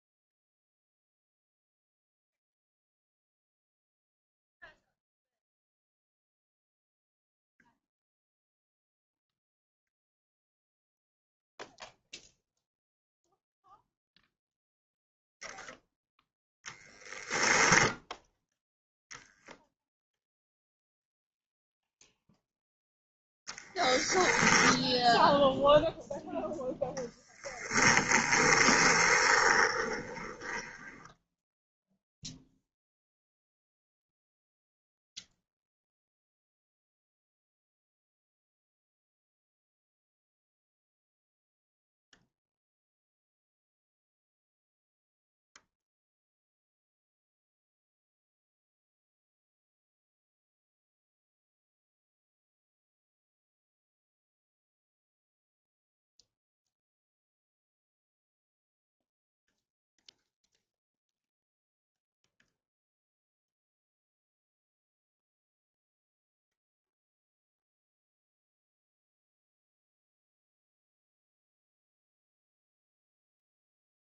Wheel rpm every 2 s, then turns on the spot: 0, 0, 0, 0, 0, 0, 0, 0, 0, 0, 0, 10, 0, 10, 20, 10, 0, 0, 0, 0, 0, 0, 0, 0, 0, 0, 0, 0, 0, 0, 0, 0, 0, 0, 0, 0, 0.
28-32